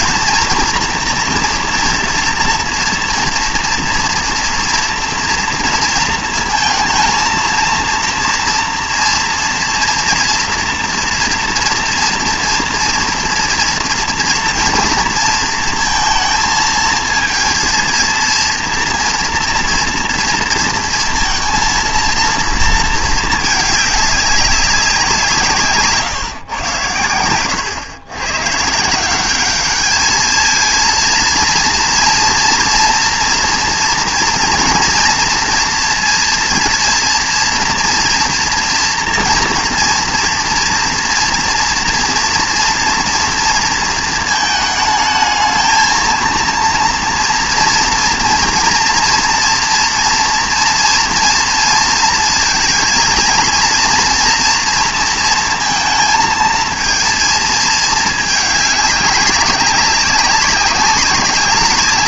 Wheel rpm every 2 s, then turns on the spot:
230, 230, 230, 220, 230, 230, 230, 230, 220, 230, 230, 230, 190, 120, 130, 220, 230, 230, 230, 230, 230, 240, 220, 230, 230, 230, 230, 230, 230, 200, 200.
none